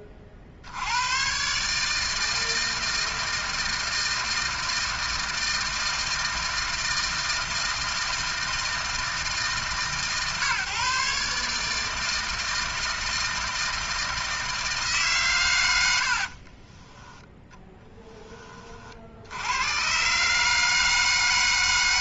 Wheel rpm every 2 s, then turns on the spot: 100, 160, 160, 160, 160, 140, 160, 160, 10, 60, 160.
16-18